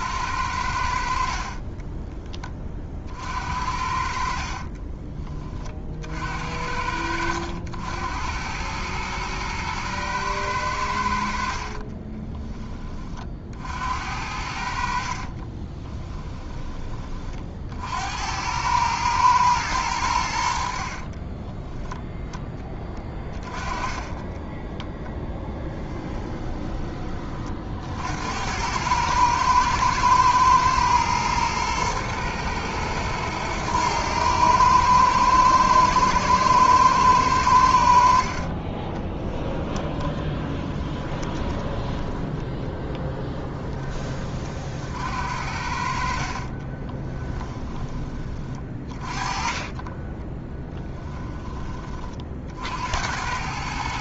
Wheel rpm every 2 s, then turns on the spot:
90, 40, 40, 60, 100, 100, 20, 60, 20, 100, 70, 20, 10, 20, 90, 110, 110, 110, 110, 40, 20, 10, 50, 30, 30, 20, 60.
4-6 24-26 38-42 46-48 50-52